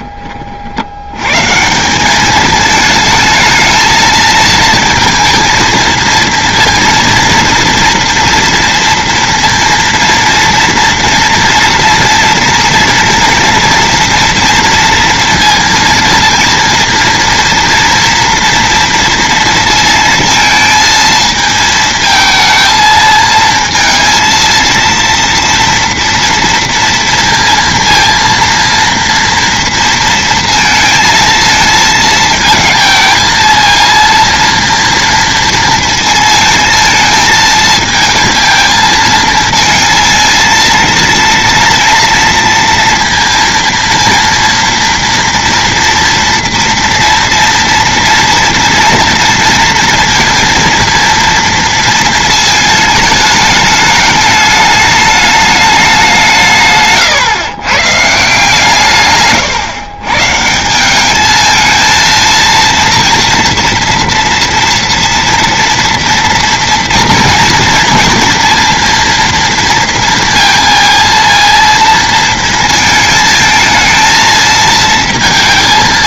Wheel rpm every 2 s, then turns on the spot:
60, 220, 220, 230, 230, 230, 230, 240, 230, 230, 220, 220, 230, 230, 230, 230, 220, 230, 220, 220, 230, 230, 230, 230, 230, 240, 220, 210, 150, 150, 160, 230, 230, 230, 230, 230, 220, 230.
none